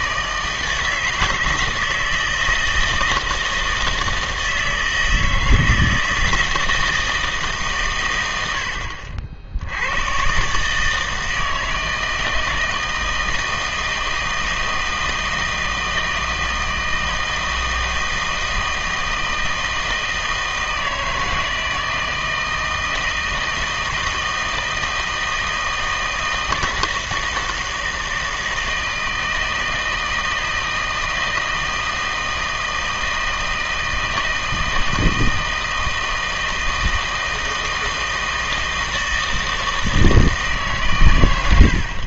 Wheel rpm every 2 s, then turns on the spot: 160, 160, 160, 160, 80, 140, 160, 160, 160, 160, 160, 160, 160, 160, 160, 160, 160, 160, 160, 160, 150.
none